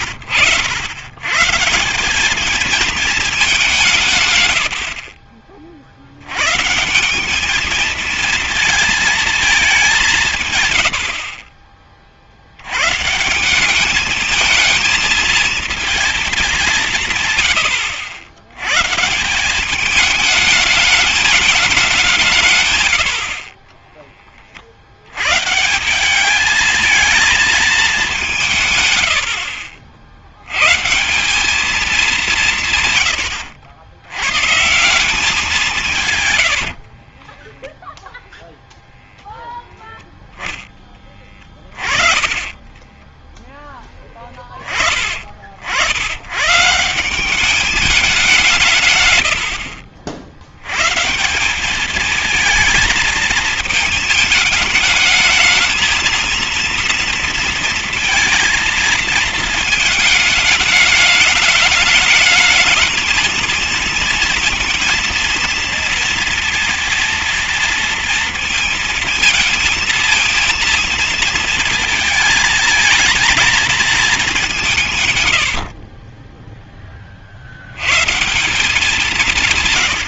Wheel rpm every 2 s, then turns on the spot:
90, 210, 110, 130, 220, 140, 60, 220, 200, 100, 210, 140, 40, 210, 170, 110, 170, 120, 130, 0, 0, 20, 20, 110, 180, 90, 220, 210, 230, 230, 210, 220, 230, 230, 230, 230, 220, 190, 20, 180.
36-38 42-44